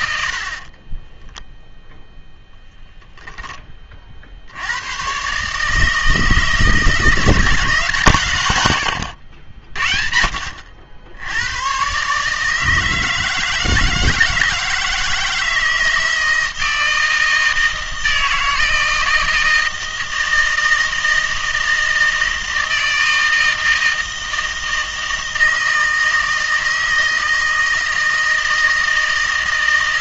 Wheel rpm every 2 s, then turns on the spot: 50, 0, 80, 160, 120, 60, 160, 160, 160, 160, 160, 160, 160, 160, 160.
none